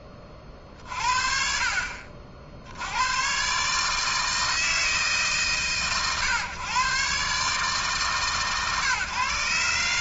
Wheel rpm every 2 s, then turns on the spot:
10, 100, 150, 120, 140.
none